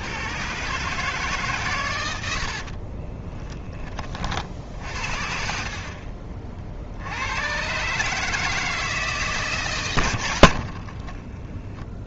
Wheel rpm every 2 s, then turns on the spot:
140, 30, 60, 70, 150, 40.
2-4 10-12